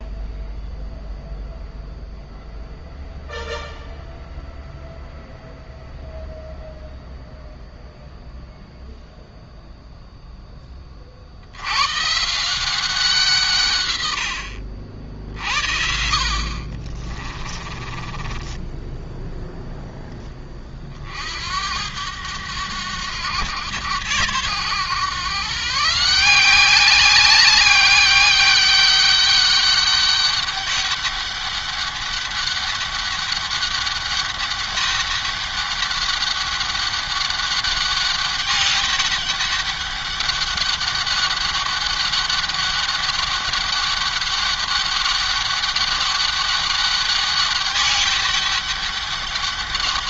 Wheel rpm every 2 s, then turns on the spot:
0, 0, 0, 0, 0, 70, 160, 60, 30, 0, 70, 100, 140, 200, 200, 200, 200, 200, 200, 200, 200, 200, 200, 200, 200.
16-18